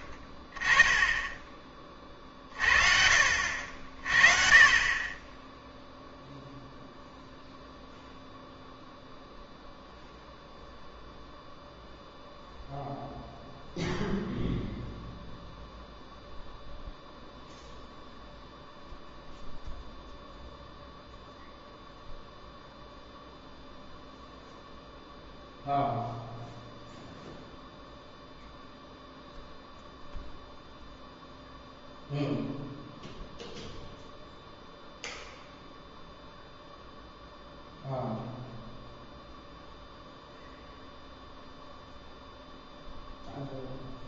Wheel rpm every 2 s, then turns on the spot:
20, 40, 30, 0, 0, 0, 0, 0, 0, 0, 0, 0, 0, 0, 0, 0, 0, 0, 0, 0, 0, 0.
none